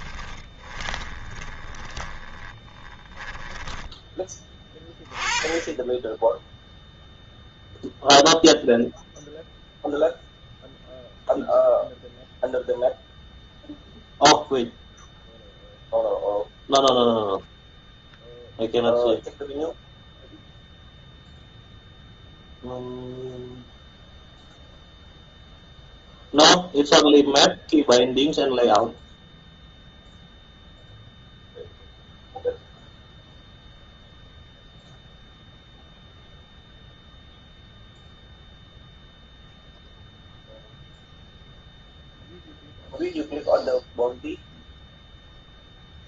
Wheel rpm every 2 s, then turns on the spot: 20, 20, 20, 10, 0, 0, 0, 0, 0, 0, 0, 0, 0, 0, 0, 0, 0, 0, 0, 0, 0, 0, 0.
0-4